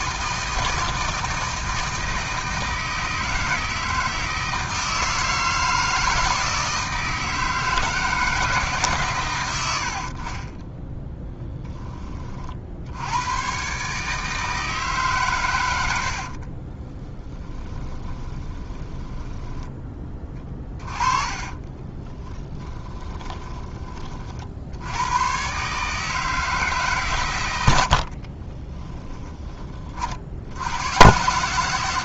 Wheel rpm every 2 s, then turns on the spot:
160, 160, 160, 160, 130, 10, 80, 150, 20, 10, 20, 20, 90, 140, 20, 110.
16-24 28-30